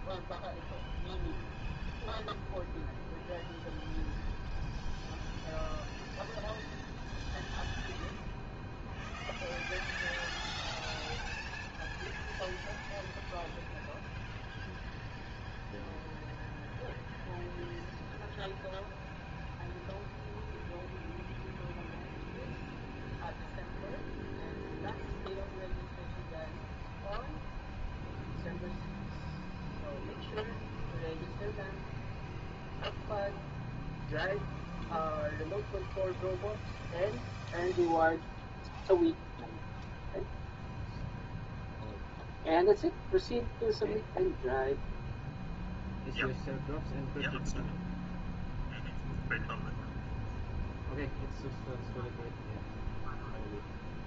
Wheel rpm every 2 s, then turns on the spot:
0, 0, 0, 0, 0, 0, 0, 0, 0, 0, 0, 0, 0, 0, 0, 0, 0, 0, 0, 0, 0, 0, 0, 0, 0, 0, 0.
none